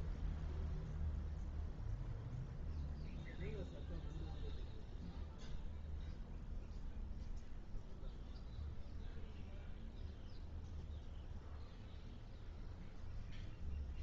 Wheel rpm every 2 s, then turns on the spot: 0, 0, 0, 0, 0, 0, 0.
none